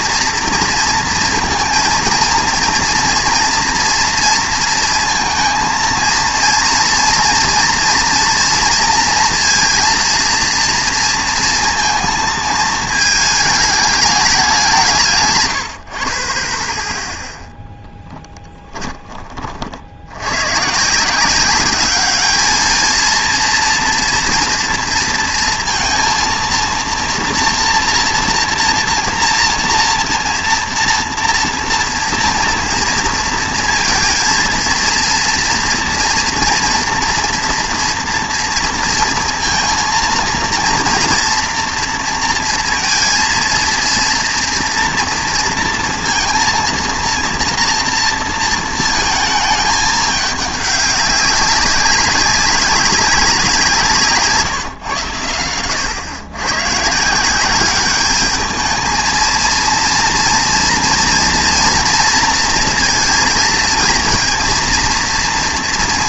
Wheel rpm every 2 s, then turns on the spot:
230, 230, 230, 230, 230, 230, 220, 180, 20, 20, 120, 220, 230, 230, 240, 230, 230, 230, 240, 230, 230, 230, 230, 230, 230, 200, 190, 150, 120, 220, 230, 230, 230.
18-20